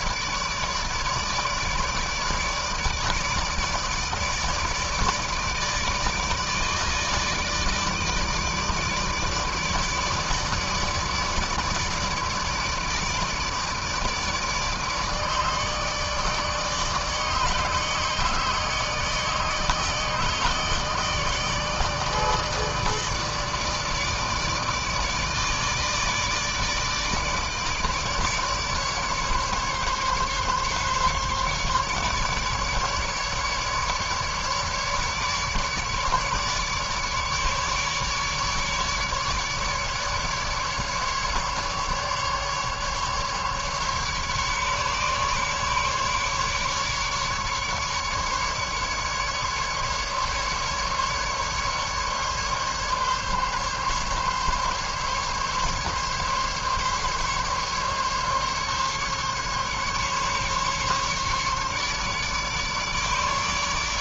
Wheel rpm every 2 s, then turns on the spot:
150, 150, 150, 150, 160, 160, 160, 160, 160, 150, 160, 150, 160, 150, 150, 140, 150, 150, 150, 150, 150, 140, 150, 150, 150, 140, 140, 140, 140, 140, 140, 150.
none